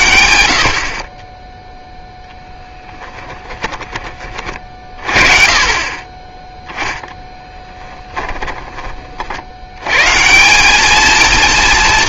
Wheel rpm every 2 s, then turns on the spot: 70, 10, 40, 10, 20, 190.
none